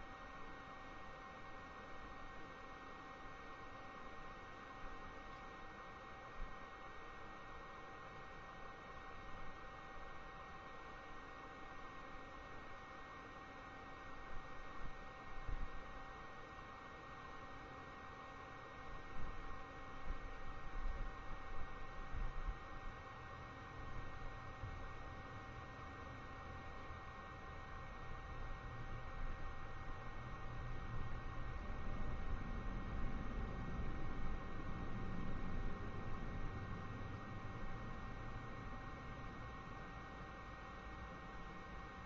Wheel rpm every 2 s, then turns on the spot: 0, 0, 0, 0, 0, 0, 0, 0, 0, 0, 0, 0, 0, 0, 0, 0, 0, 0, 0, 0, 0.
none